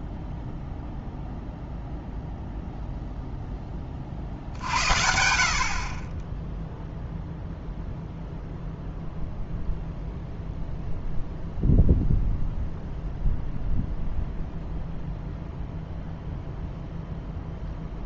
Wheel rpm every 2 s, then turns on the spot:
0, 0, 60, 0, 0, 0, 0, 0, 0.
none